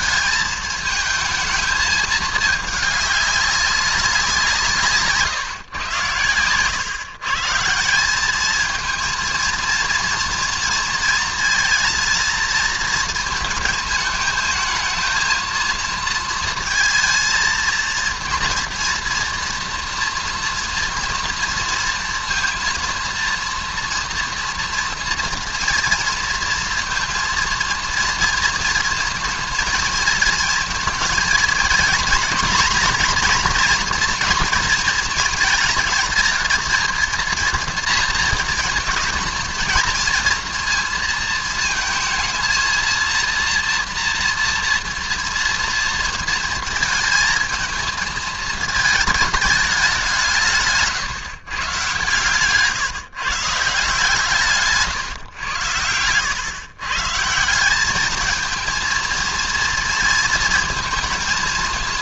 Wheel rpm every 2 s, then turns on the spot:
220, 210, 150, 130, 220, 220, 220, 220, 230, 230, 230, 230, 230, 230, 230, 220, 240, 230, 230, 230, 230, 230, 230, 220, 220, 150, 150, 150, 130, 220, 220.
none